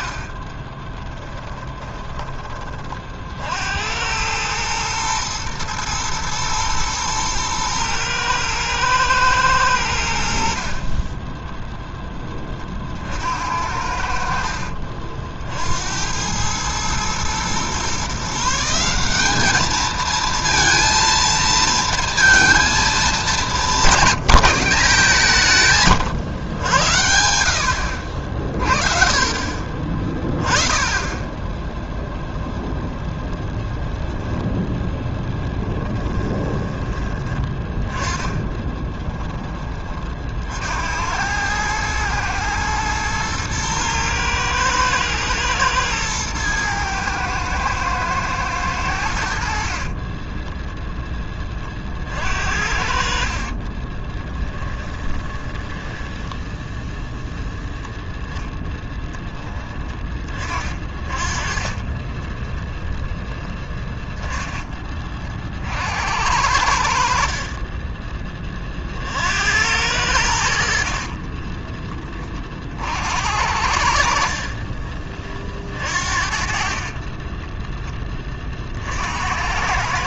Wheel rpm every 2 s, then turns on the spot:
10, 30, 110, 110, 110, 50, 30, 50, 110, 170, 230, 220, 170, 100, 40, 10, 0, 10, 20, 20, 60, 110, 110, 110, 100, 10, 60, 20, 10, 10, 30, 0, 10, 80, 40, 60, 50, 40, 40, 40.
0-2 10-12 28-30 36-40 50-52 54-58 74-78